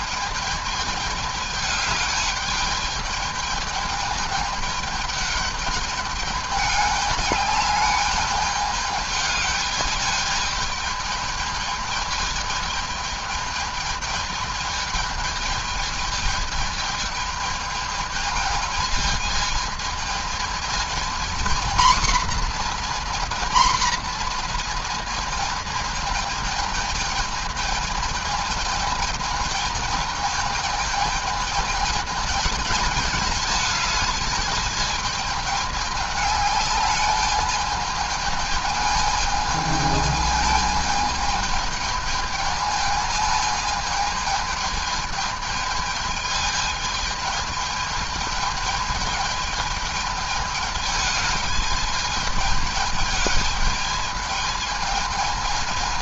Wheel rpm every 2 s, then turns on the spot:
210, 210, 210, 210, 210, 210, 210, 210, 210, 220, 220, 240, 230, 220, 220, 220, 220, 220, 210, 220, 220, 220, 210, 210, 220, 210, 220, 220.
none